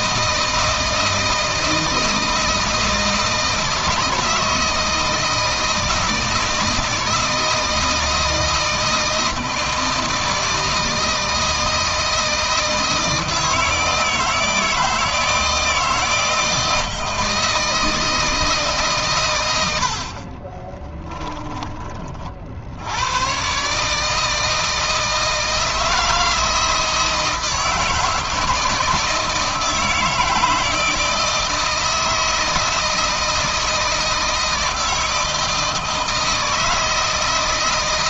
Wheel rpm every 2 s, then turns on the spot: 160, 160, 160, 160, 160, 160, 160, 160, 160, 150, 20, 80, 160, 160, 160, 160, 160, 160, 160.
20-22